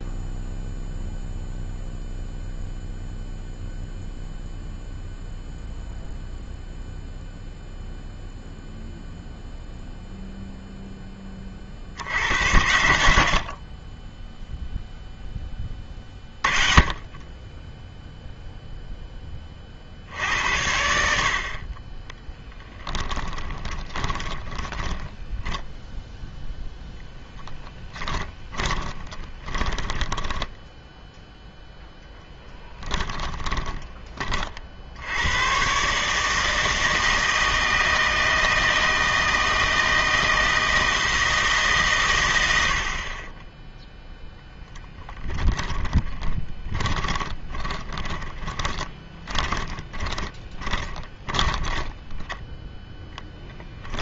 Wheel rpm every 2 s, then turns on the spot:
0, 0, 0, 0, 0, 0, 90, 0, 30, 0, 80, 10, 20, 0, 20, 10, 10, 50, 160, 160, 160, 80, 20, 20, 20, 20, 10.
24-26 28-32 44-52